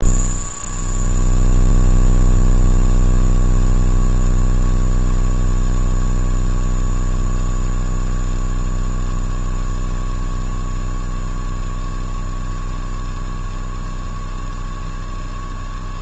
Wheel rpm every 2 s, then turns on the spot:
0, 0, 0, 0, 0, 0, 0, 0.
none